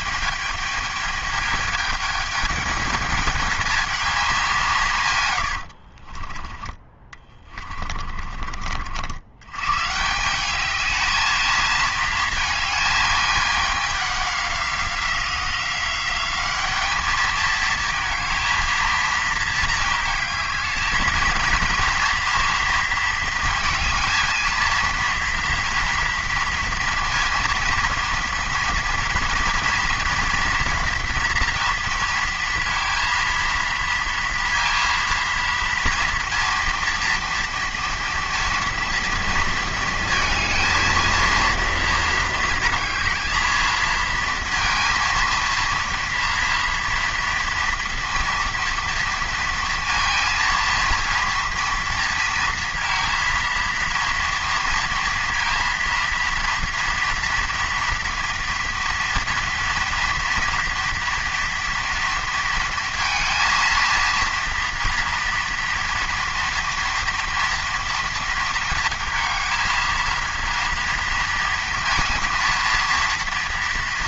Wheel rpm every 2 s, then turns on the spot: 210, 210, 180, 20, 40, 200, 220, 190, 200, 220, 220, 230, 230, 230, 230, 230, 230, 230, 240, 230, 230, 220, 230, 230, 230, 230, 230, 230, 230, 230, 230, 230, 230, 230, 230, 230, 230.
none